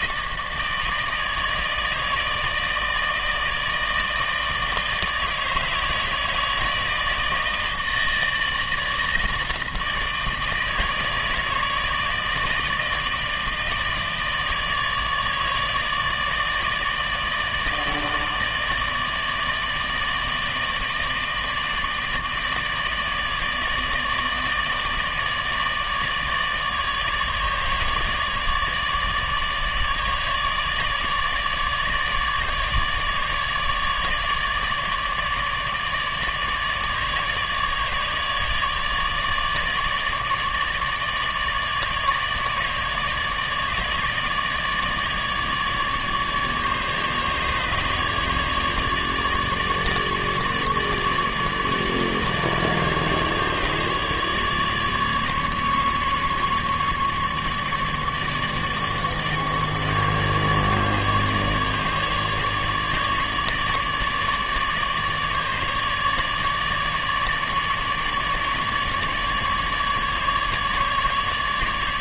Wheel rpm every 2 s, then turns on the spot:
160, 160, 160, 160, 160, 150, 160, 150, 160, 150, 150, 160, 150, 150, 150, 150, 150, 150, 150, 150, 150, 150, 150, 150, 150, 150, 150, 150, 150, 150, 150, 150, 150, 150, 150, 150.
none